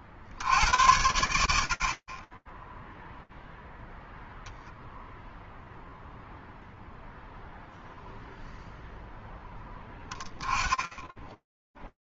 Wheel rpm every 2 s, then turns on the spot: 50, 0, 0, 0, 10, 0.
none